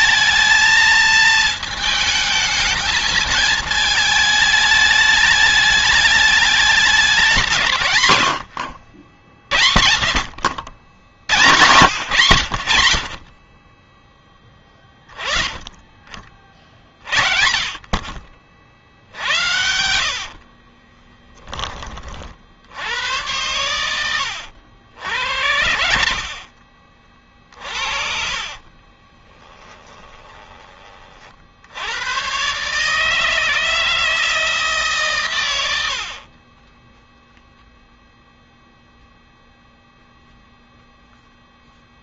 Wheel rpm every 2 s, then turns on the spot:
220, 220, 210, 200, 70, 80, 70, 10, 50, 60, 30, 80, 80, 40, 30, 30, 140, 150, 20, 0, 0.
18-22 28-30